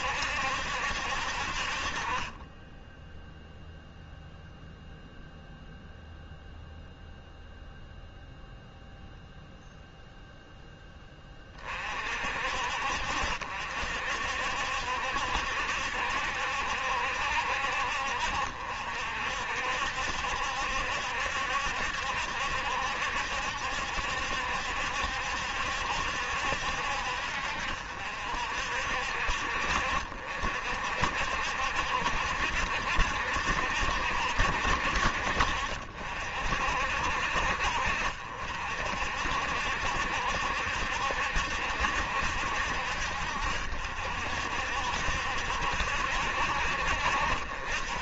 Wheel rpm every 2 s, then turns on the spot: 60, 10, 0, 0, 0, 10, 60, 60, 70, 60, 70, 70, 70, 60, 60, 60, 60, 60, 60, 60, 70, 60, 60, 60.
none